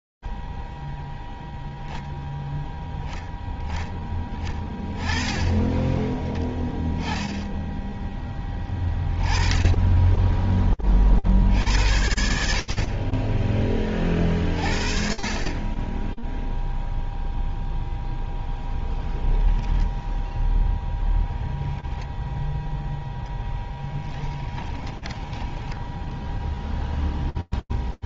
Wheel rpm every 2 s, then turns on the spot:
0, 0, 10, 10, 10, 10, 50, 40, 0, 0, 0, 0, 10, 0.
24-26